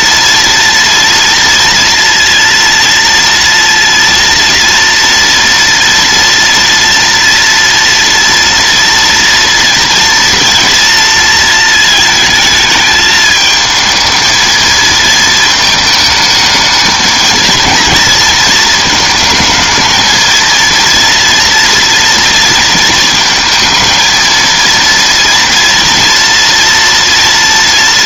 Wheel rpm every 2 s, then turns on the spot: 230, 230, 230, 230, 230, 230, 220, 220, 220, 220, 230, 230, 230, 230.
none